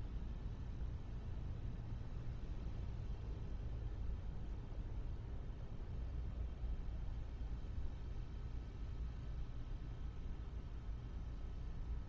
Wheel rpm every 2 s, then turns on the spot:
0, 0, 0, 0, 0, 0.
none